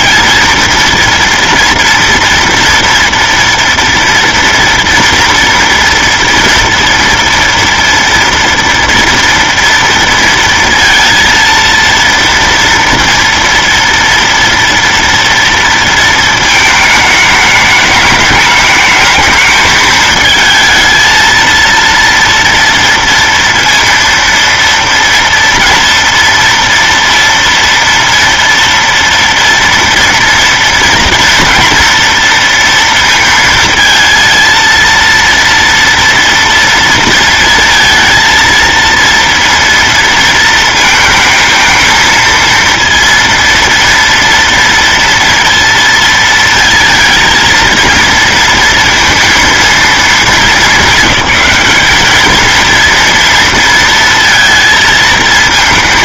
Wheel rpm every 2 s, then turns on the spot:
230, 230, 240, 230, 230, 230, 230, 230, 220, 210, 220, 230, 230, 230, 230, 230, 240, 230, 230, 230, 230, 230, 230, 230, 230, 210, 230, 230.
none